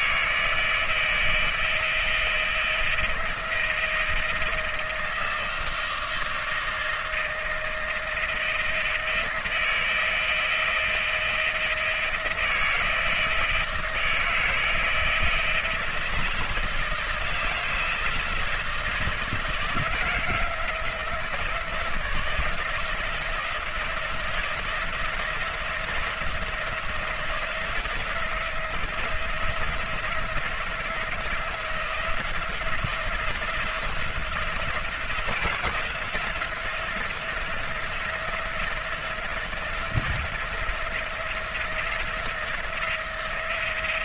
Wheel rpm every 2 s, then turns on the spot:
160, 160, 160, 160, 170, 160, 160, 160, 160, 160, 160, 160, 170, 170, 170, 170, 170, 170, 170, 170, 170, 170.
none